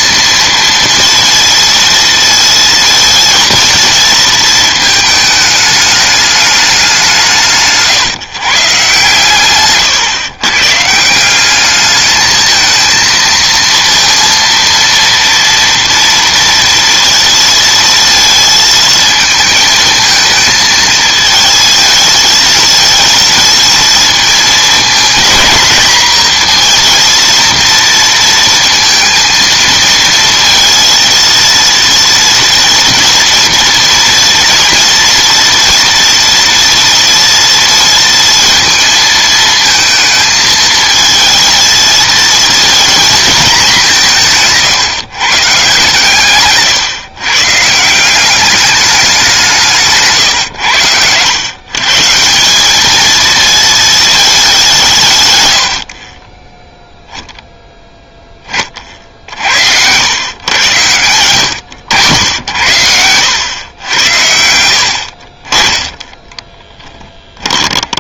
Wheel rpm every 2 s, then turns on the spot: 230, 230, 220, 200, 130, 150, 220, 230, 230, 220, 220, 220, 220, 230, 230, 230, 230, 230, 230, 230, 220, 230, 140, 140, 200, 100, 200, 190, 0, 30, 110, 70, 60, 10.
60-62 66-68